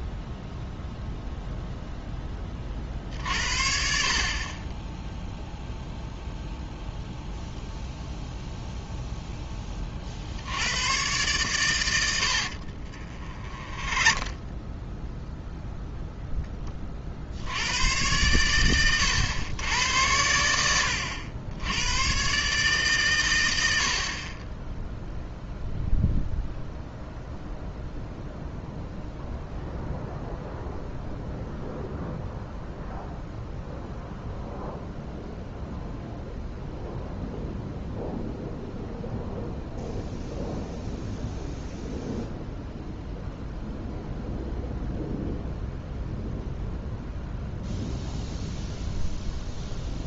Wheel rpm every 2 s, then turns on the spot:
0, 30, 20, 0, 0, 90, 50, 10, 10, 110, 90, 130, 20, 0, 0, 0, 0, 0, 0, 0, 0, 0, 0, 0, 0.
12-16